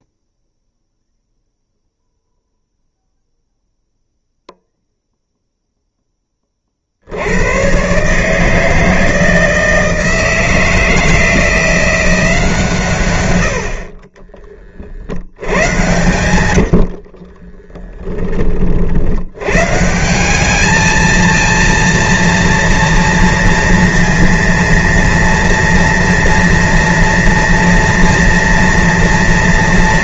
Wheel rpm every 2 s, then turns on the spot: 0, 0, 0, 30, 150, 160, 160, 30, 110, 30, 190, 230, 230, 230, 230.
16-18